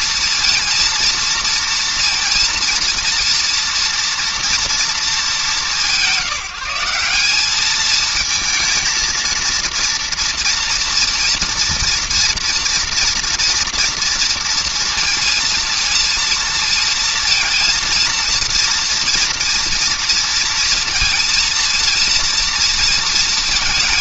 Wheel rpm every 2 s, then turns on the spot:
230, 230, 240, 170, 220, 230, 230, 230, 230, 230, 230, 230.
none